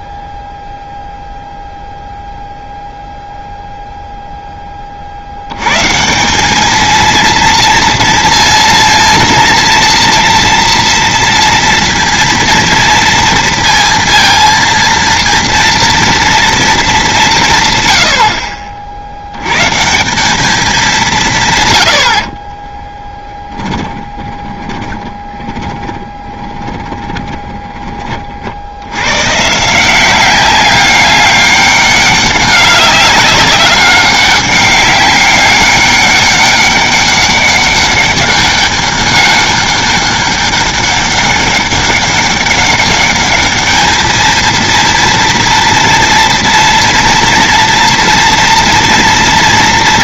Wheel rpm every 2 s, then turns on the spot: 0, 0, 10, 210, 230, 230, 230, 230, 230, 50, 210, 40, 20, 20, 60, 190, 200, 200, 200, 200, 200, 200, 230, 230, 230.
22-28